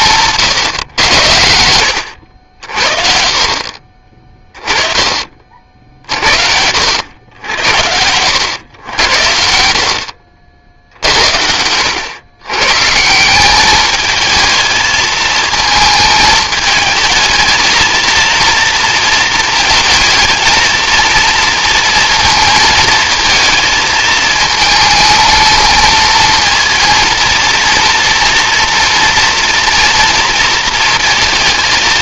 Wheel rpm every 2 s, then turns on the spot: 130, 60, 20, 70, 100, 70, 120, 220, 220, 230, 220, 220, 220, 230, 230, 230.
none